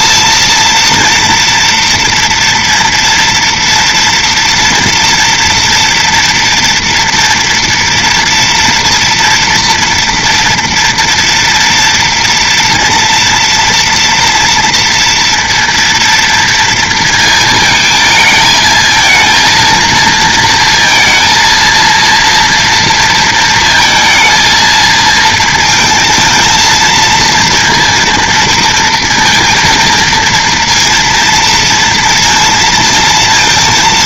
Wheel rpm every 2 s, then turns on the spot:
230, 230, 240, 230, 240, 240, 230, 230, 230, 220, 230, 230, 230, 230, 230, 230, 230.
none